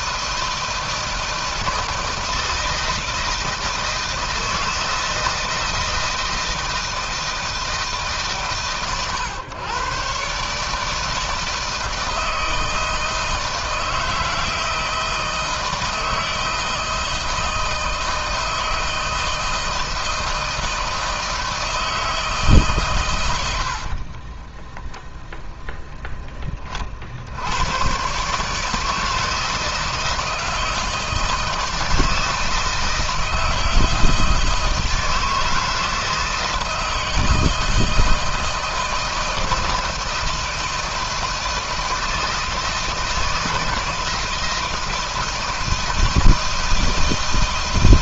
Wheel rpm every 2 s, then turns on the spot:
160, 160, 160, 160, 130, 160, 160, 160, 160, 160, 160, 130, 0, 50, 160, 160, 160, 160, 160, 160, 160, 160, 160, 160.
none